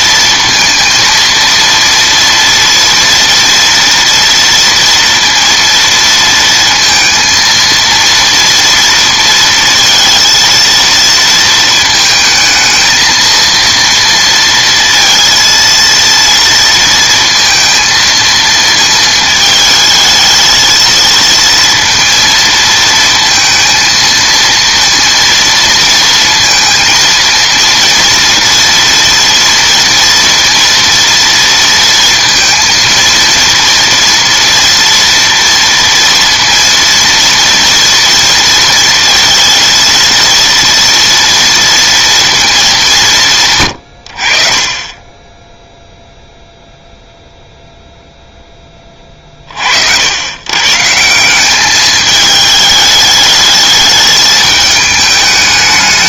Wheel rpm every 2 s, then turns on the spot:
230, 230, 230, 230, 230, 230, 220, 230, 230, 220, 220, 230, 230, 230, 230, 230, 230, 230, 230, 230, 230, 210, 30, 0, 20, 140, 210, 210.
none